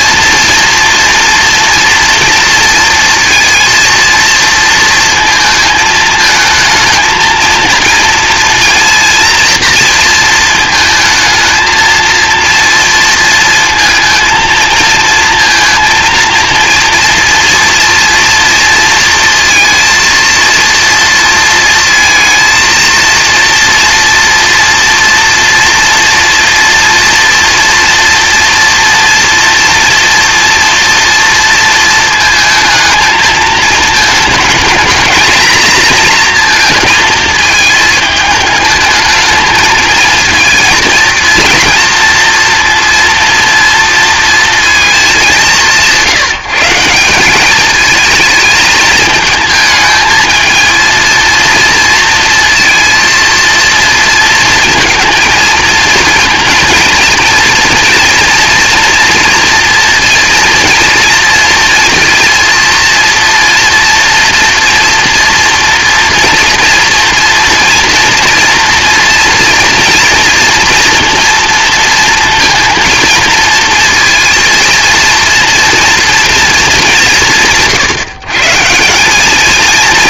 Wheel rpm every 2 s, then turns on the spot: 230, 230, 230, 220, 230, 230, 230, 230, 230, 230, 230, 230, 230, 230, 230, 230, 230, 220, 230, 220, 230, 230, 230, 170, 220, 230, 230, 230, 230, 230, 230, 230, 230, 230, 230, 230, 230, 230, 220, 160.
none